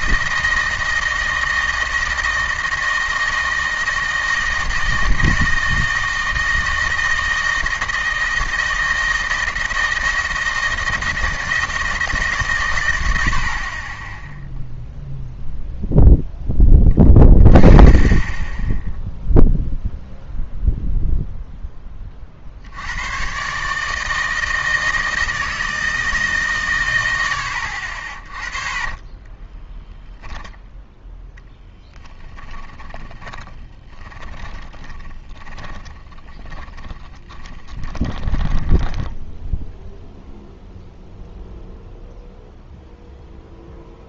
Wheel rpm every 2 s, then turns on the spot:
160, 160, 160, 160, 160, 160, 130, 0, 20, 10, 0, 70, 160, 150, 30, 0, 20, 20, 20, 20, 0, 0.
28-30 32-40